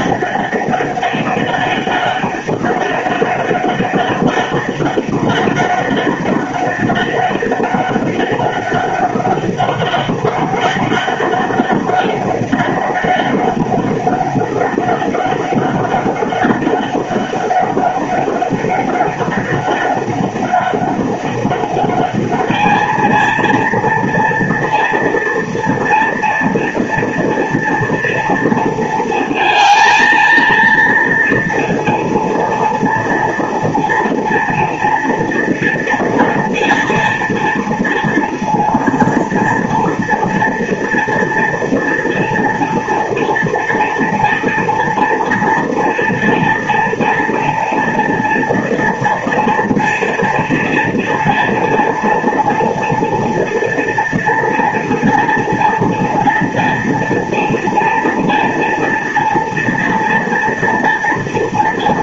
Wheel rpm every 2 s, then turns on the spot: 200, 200, 200, 200, 200, 200, 200, 200, 200, 200, 200, 210, 230, 230, 230, 230, 230, 240, 240, 230, 230, 230, 230, 230, 230, 230, 230, 230, 230, 230, 230.
none